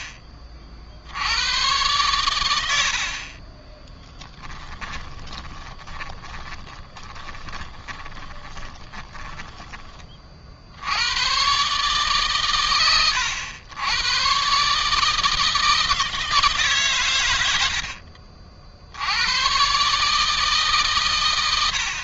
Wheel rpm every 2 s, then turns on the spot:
50, 80, 10, 20, 20, 90, 110, 150, 130, 80, 140.
4-10